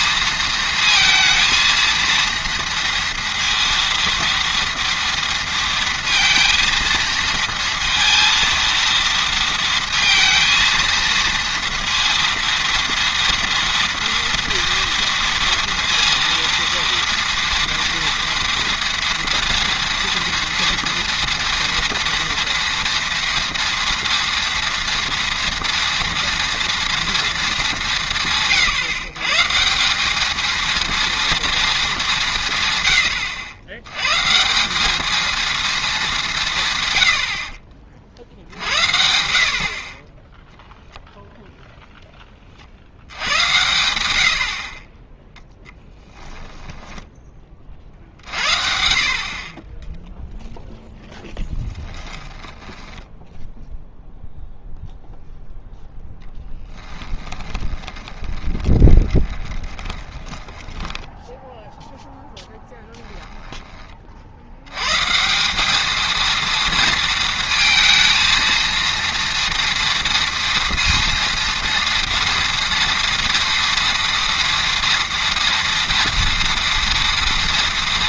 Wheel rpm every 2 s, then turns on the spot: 230, 230, 230, 230, 230, 230, 230, 230, 230, 230, 230, 230, 230, 230, 140, 230, 130, 180, 140, 60, 10, 50, 30, 10, 50, 0, 10, 0, 10, 20, 10, 10, 100, 230, 230, 230, 240, 230, 240.
46-48 52-54 56-62